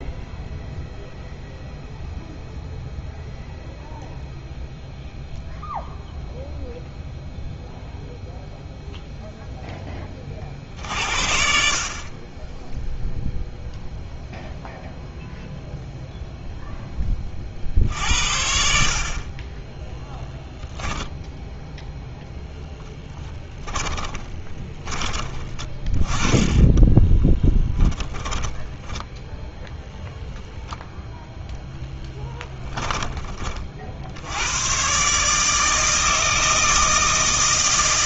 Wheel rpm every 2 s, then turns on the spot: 0, 0, 0, 0, 0, 50, 10, 0, 0, 60, 10, 0, 20, 20, 10, 0, 10, 120, 160.
24-30